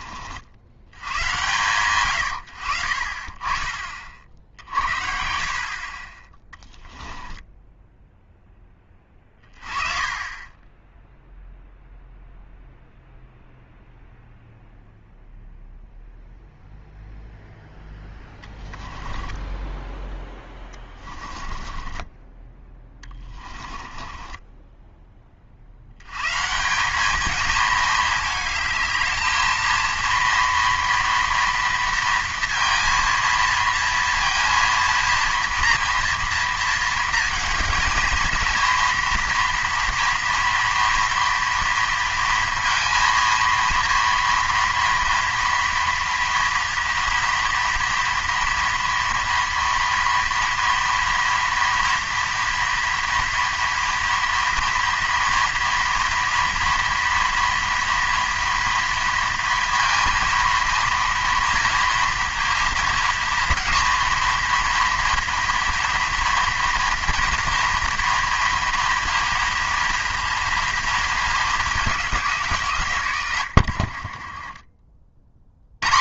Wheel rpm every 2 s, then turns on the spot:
80, 70, 60, 10, 10, 10, 0, 0, 0, 20, 20, 10, 10, 170, 220, 230, 230, 230, 230, 230, 230, 230, 230, 230, 240, 230, 230, 230, 230, 230, 230, 230, 230, 230, 230, 230, 140, 30.
6-8 18-26 74-76